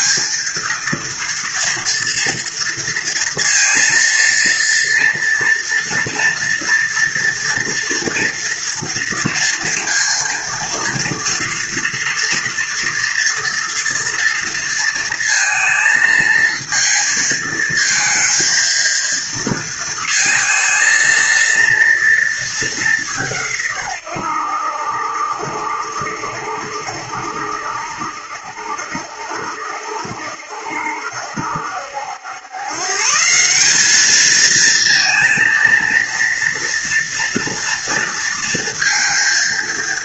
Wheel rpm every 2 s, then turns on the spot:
230, 230, 230, 230, 230, 230, 230, 230, 220, 230, 220, 200, 80, 70, 70, 70, 130, 230, 230, 230.
none